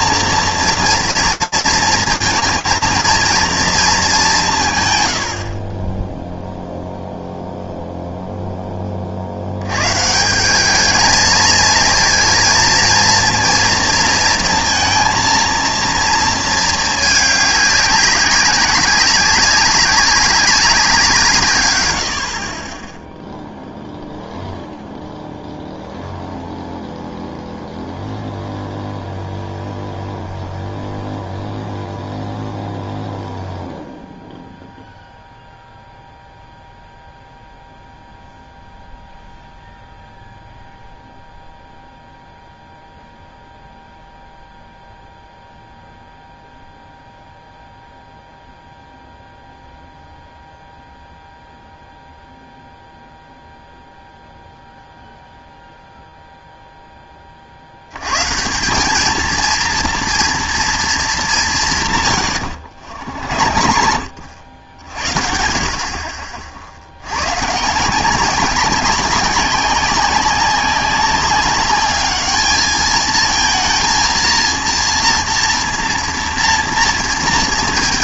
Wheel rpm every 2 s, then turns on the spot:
230, 230, 150, 0, 10, 190, 230, 230, 230, 190, 200, 50, 0, 0, 0, 0, 0, 0, 0, 0, 0, 0, 0, 0, 0, 0, 0, 0, 0, 160, 240, 100, 70, 50, 190, 200, 210, 230, 230.
62-64